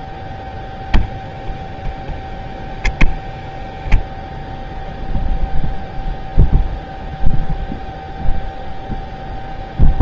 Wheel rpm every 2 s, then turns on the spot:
0, 0, 0, 0, 0.
none